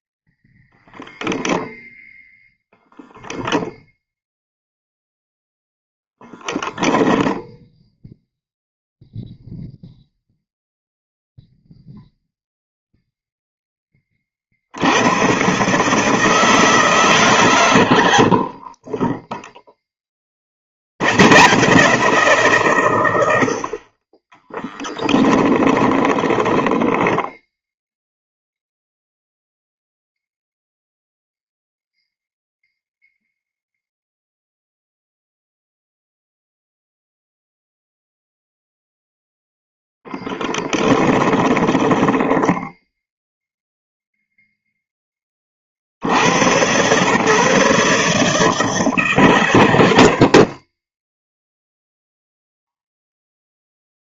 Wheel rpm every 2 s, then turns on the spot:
0, 0, 0, 0, 0, 0, 0, 60, 160, 30, 80, 140, 10, 10, 0, 0, 0, 0, 0, 0, 10, 10, 0, 110, 150, 30, 0.
18-20 24-28 40-44